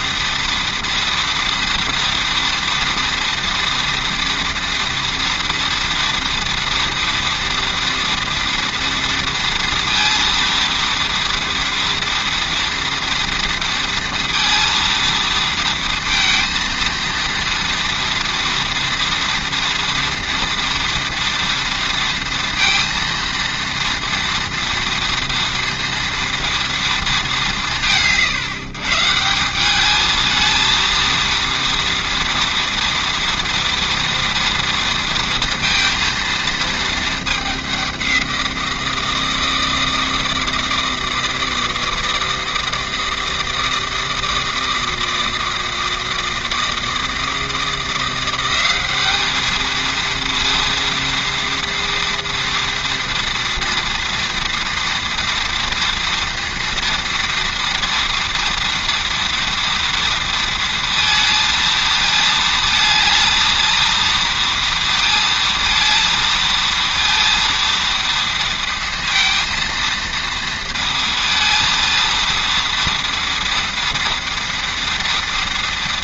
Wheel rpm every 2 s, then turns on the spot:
230, 230, 230, 230, 230, 230, 230, 230, 230, 230, 230, 230, 230, 230, 140, 220, 230, 230, 230, 170, 160, 160, 160, 160, 190, 230, 230, 230, 230, 240, 230, 220, 230, 230, 230, 230, 230, 230.
none